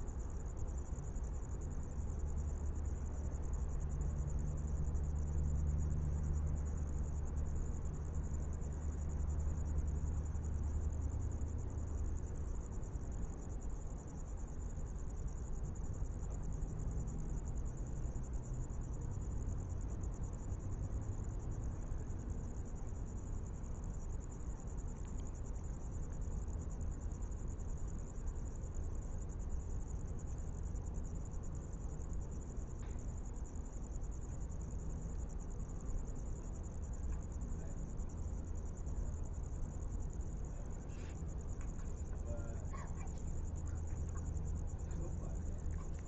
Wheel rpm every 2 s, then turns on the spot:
0, 0, 0, 0, 0, 0, 0, 0, 0, 0, 0, 0, 0, 0, 0, 0, 0, 0, 0, 0, 0, 0, 0.
none